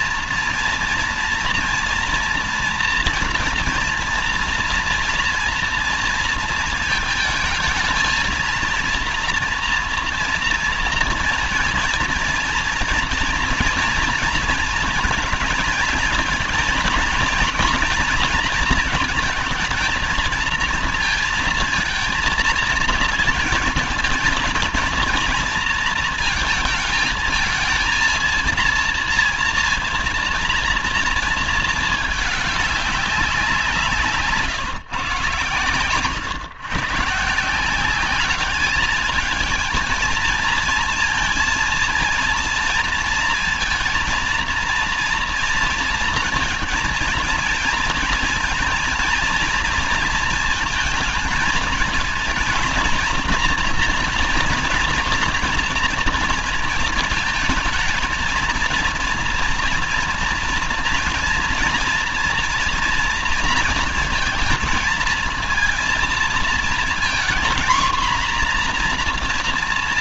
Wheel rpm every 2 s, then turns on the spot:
240, 230, 240, 230, 230, 230, 230, 230, 230, 220, 230, 230, 230, 220, 220, 230, 200, 150, 120, 210, 230, 230, 230, 230, 230, 230, 230, 240, 230, 230, 230, 230, 220, 230, 240.
none